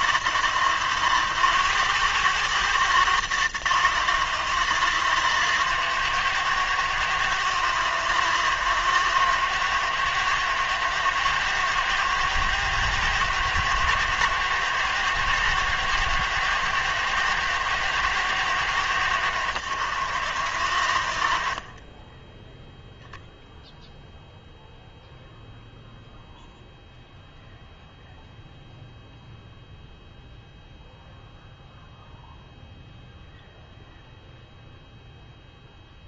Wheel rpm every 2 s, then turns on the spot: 170, 190, 170, 170, 170, 150, 150, 160, 160, 150, 140, 10, 0, 0, 0, 0, 0, 0.
none